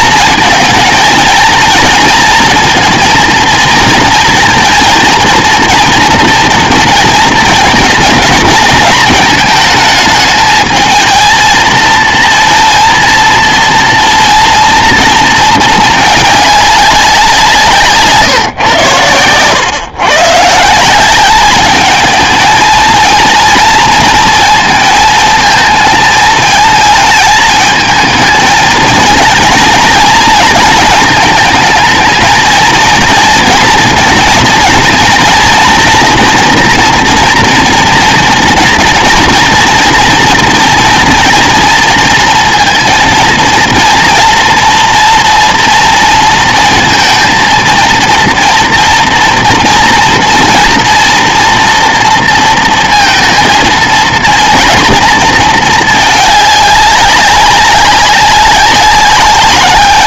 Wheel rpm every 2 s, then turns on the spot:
230, 230, 230, 230, 220, 210, 230, 230, 200, 120, 170, 220, 220, 220, 230, 220, 230, 230, 230, 230, 230, 230, 230, 230, 240, 230, 230, 230, 200, 190.
none